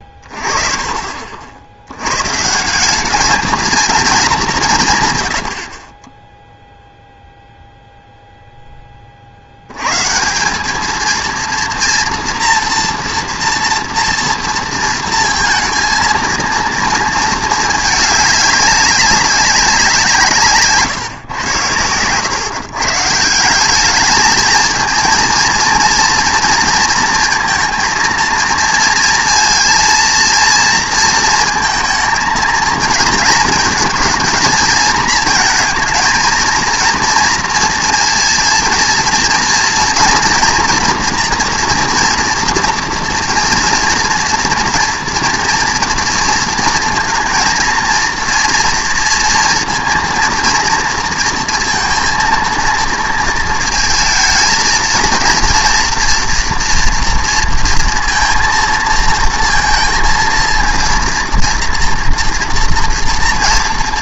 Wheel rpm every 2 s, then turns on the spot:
30, 180, 160, 0, 10, 210, 230, 230, 230, 200, 140, 150, 230, 230, 230, 230, 230, 230, 230, 230, 240, 230, 230, 230, 230, 230, 230, 230, 230, 230, 230, 230.
none